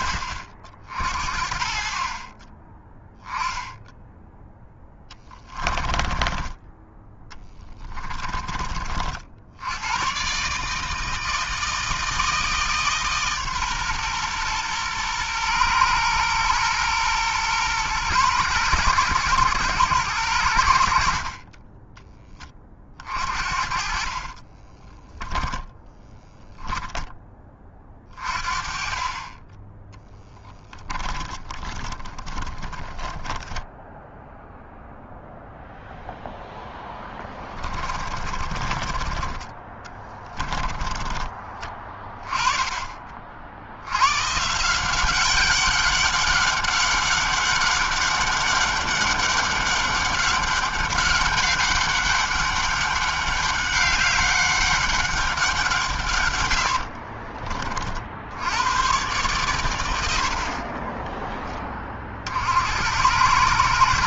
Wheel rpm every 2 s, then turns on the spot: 60, 10, 20, 10, 50, 160, 150, 120, 120, 110, 50, 50, 10, 10, 30, 20, 10, 0, 10, 30, 20, 40, 190, 200, 200, 200, 200, 190, 50, 120, 20, 100.
4-6 22-26 30-34 36-42 56-58 60-62